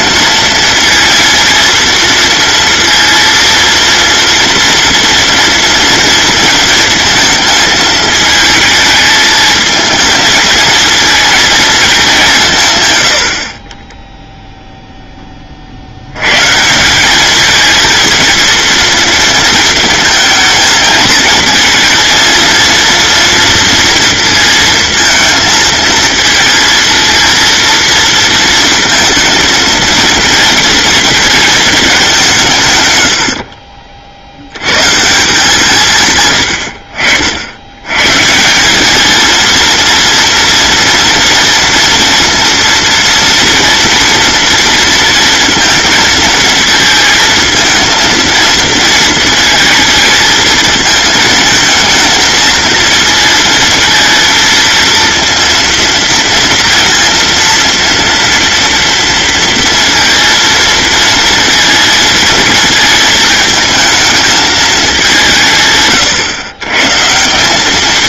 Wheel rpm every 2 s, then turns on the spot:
230, 230, 230, 220, 220, 230, 110, 0, 170, 230, 220, 230, 230, 230, 230, 230, 130, 120, 90, 200, 230, 230, 230, 230, 230, 230, 230, 230, 230, 230, 230, 230, 210, 130.
none